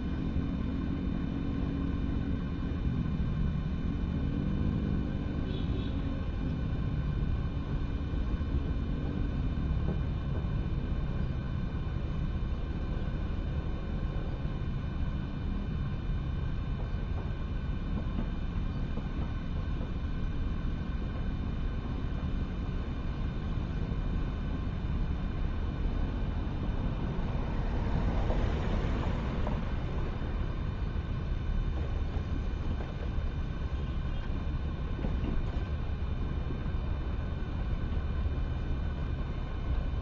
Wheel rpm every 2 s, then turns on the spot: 0, 0, 0, 0, 0, 0, 0, 0, 0, 0, 0, 0, 0, 0, 0, 0, 0, 0, 0, 0.
none